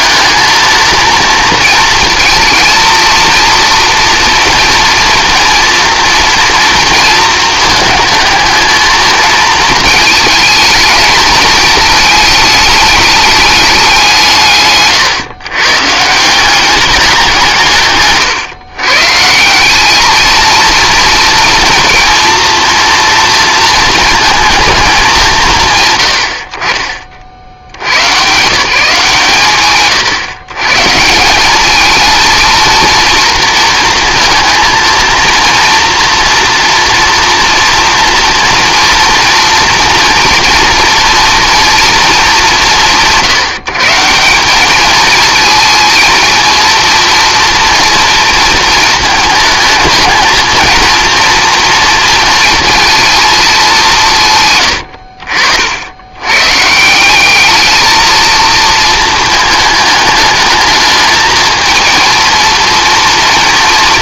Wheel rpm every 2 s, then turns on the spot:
220, 230, 230, 230, 220, 220, 210, 140, 190, 130, 230, 230, 220, 40, 150, 150, 230, 230, 230, 230, 230, 190, 200, 230, 230, 230, 230, 120, 140, 230, 220, 230.
54-56